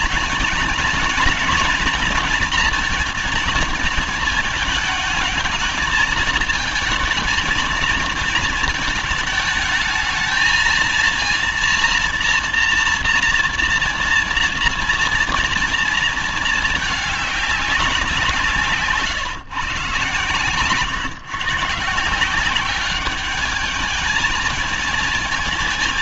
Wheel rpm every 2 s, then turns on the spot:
230, 230, 220, 220, 220, 220, 230, 230, 220, 150, 130, 200, 220.
none